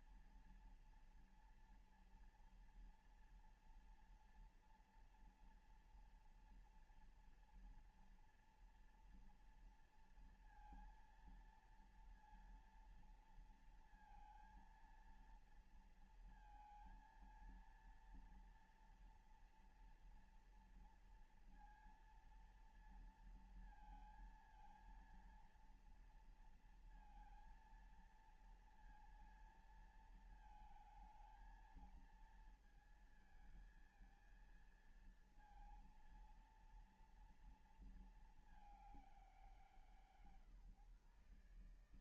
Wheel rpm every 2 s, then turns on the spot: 230, 240, 230, 230, 240, 230, 230, 230, 230, 230, 230, 230, 230, 230, 230, 220, 220, 230, 230, 180, 150.
none